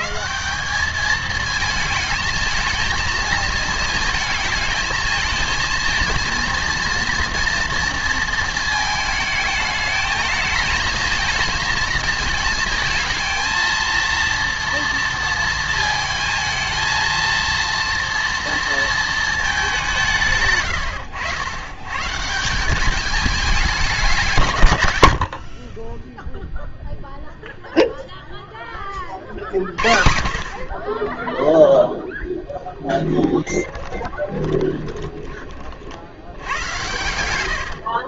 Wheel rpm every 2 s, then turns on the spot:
190, 220, 220, 230, 220, 220, 230, 230, 220, 230, 110, 190, 130, 0, 20, 40, 20, 20, 90.
32-36